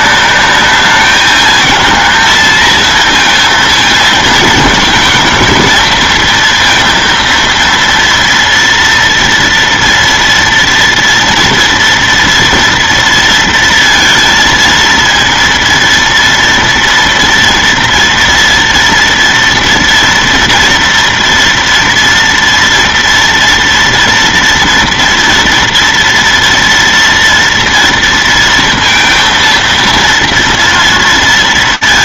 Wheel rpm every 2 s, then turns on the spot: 210, 220, 220, 230, 230, 230, 230, 230, 230, 230, 230, 230, 230, 230, 230, 230.
none